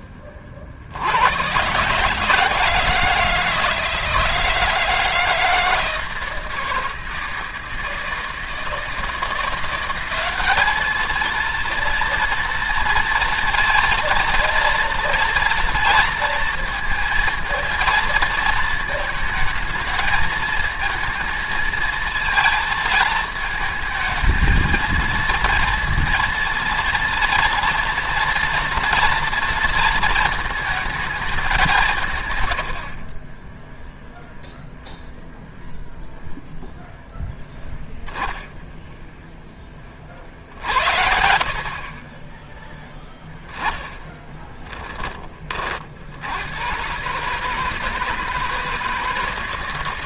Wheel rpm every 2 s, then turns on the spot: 40, 150, 160, 160, 160, 210, 230, 230, 230, 220, 220, 220, 220, 230, 230, 220, 80, 0, 0, 0, 80, 20, 20, 100, 160.
none